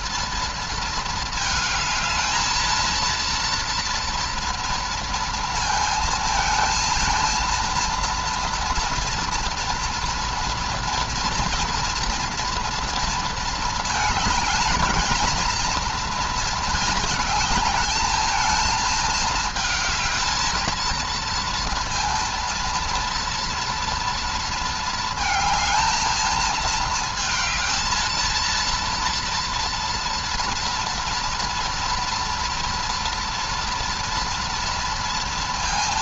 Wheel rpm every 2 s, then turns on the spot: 230, 220, 230, 230, 240, 230, 230, 220, 230, 220, 230, 230, 230, 220, 230, 230, 230, 230.
none